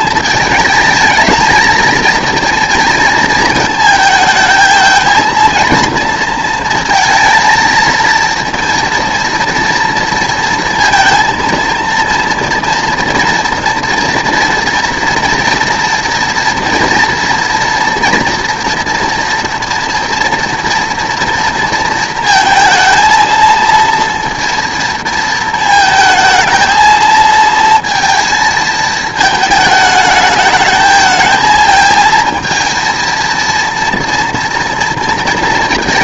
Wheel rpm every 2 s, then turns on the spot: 220, 230, 220, 230, 230, 230, 230, 230, 230, 240, 230, 230, 230, 220, 220, 220, 230, 230.
none